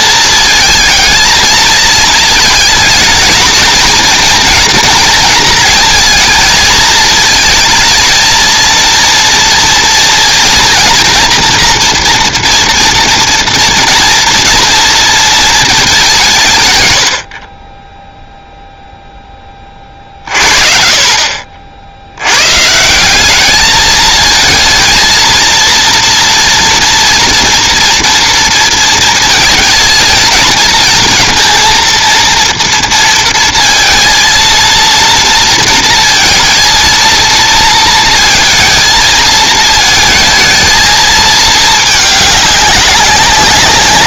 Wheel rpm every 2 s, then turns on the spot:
230, 220, 230, 220, 230, 230, 230, 240, 130, 0, 50, 140, 230, 230, 230, 220, 230, 230, 230, 230, 220, 200.
none